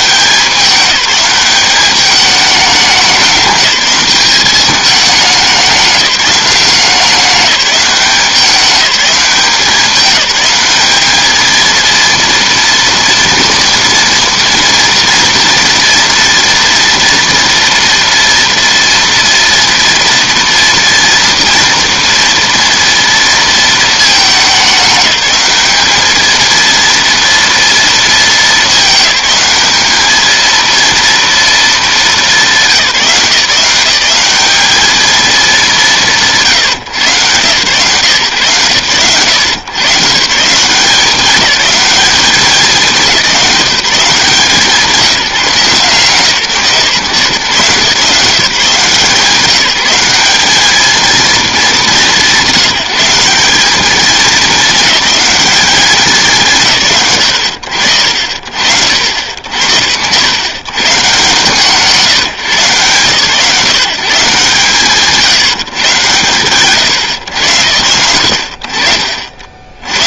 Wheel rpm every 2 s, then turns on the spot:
200, 190, 200, 190, 190, 210, 230, 240, 230, 240, 230, 230, 190, 230, 210, 230, 170, 210, 130, 100, 190, 180, 170, 140, 150, 220, 170, 210, 90, 80, 150, 130, 130, 130, 50.
none